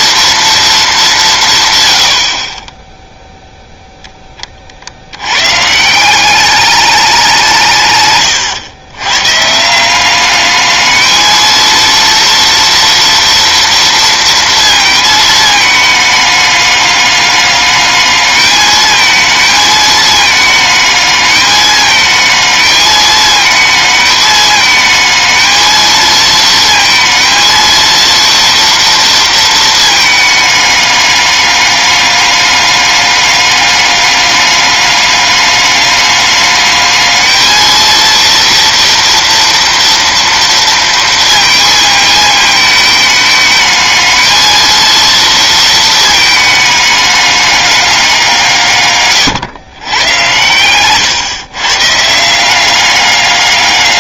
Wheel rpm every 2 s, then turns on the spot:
220, 30, 40, 200, 120, 210, 230, 230, 210, 220, 220, 220, 220, 230, 230, 210, 210, 200, 210, 230, 230, 220, 230, 210, 160, 120, 190.
2-4